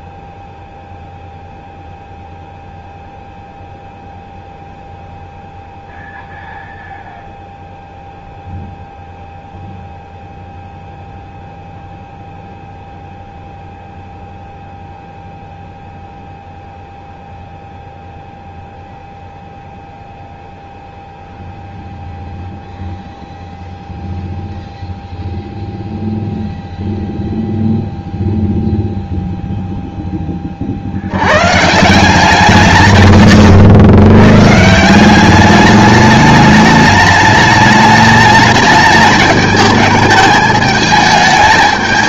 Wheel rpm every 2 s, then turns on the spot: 0, 0, 0, 0, 0, 0, 0, 0, 0, 0, 0, 0, 0, 0, 0, 50, 150, 170, 210, 210, 210.
none